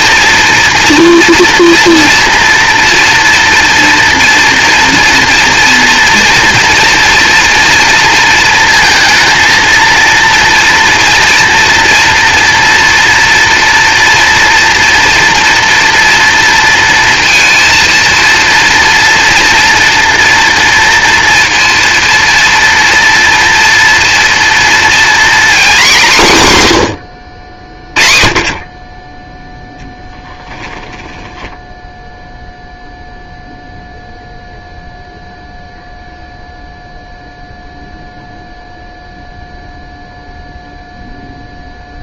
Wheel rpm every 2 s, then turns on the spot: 230, 230, 230, 230, 230, 230, 230, 230, 230, 230, 230, 230, 230, 150, 30, 10, 0, 0, 0, 0, 0.
30-32